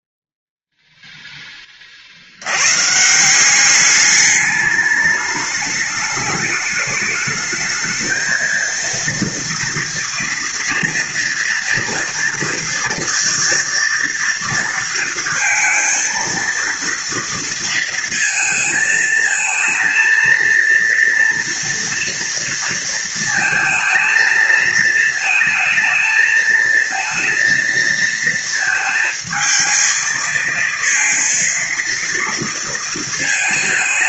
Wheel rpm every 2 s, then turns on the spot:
0, 130, 210, 210, 230, 230, 230, 230, 230, 220, 230, 230, 220, 220, 220, 230, 230.
none